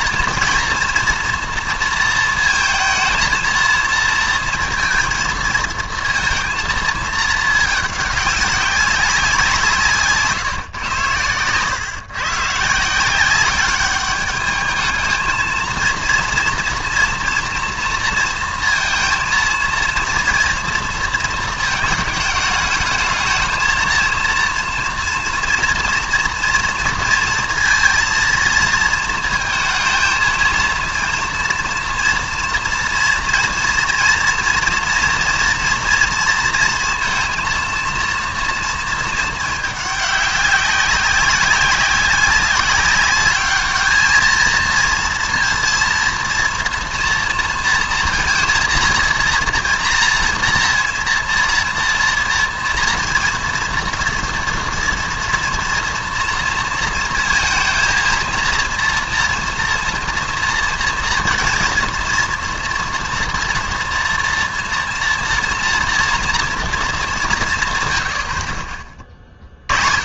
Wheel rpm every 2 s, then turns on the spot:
230, 230, 230, 230, 190, 140, 140, 210, 230, 230, 230, 210, 230, 230, 220, 220, 230, 230, 230, 230, 200, 190, 220, 230, 230, 230, 230, 230, 230, 230, 230, 230, 230, 230, 50.
none